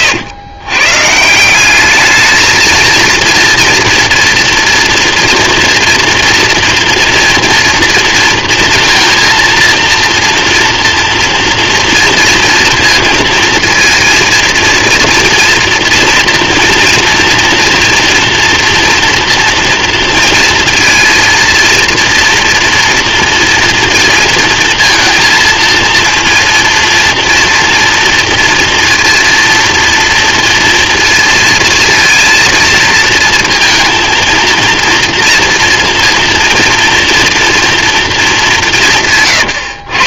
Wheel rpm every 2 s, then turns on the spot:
130, 220, 230, 240, 230, 230, 230, 230, 230, 230, 230, 230, 230, 230, 230, 230, 230, 230, 230, 180.
none